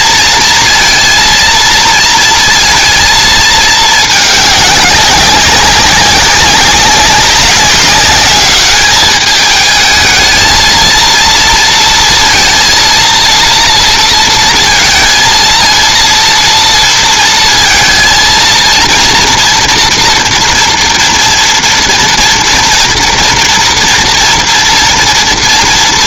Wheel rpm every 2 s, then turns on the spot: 230, 230, 200, 190, 210, 230, 230, 230, 230, 230, 240, 230, 240.
none